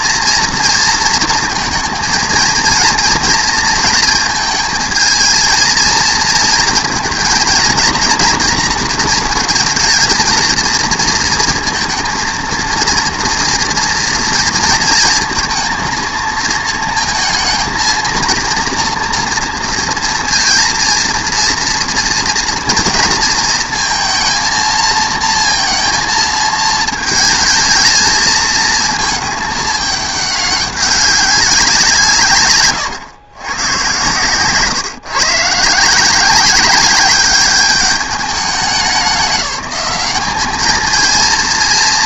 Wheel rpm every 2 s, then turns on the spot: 230, 220, 220, 230, 240, 230, 230, 230, 230, 230, 230, 230, 230, 230, 220, 200, 140, 140, 200, 200, 210.
none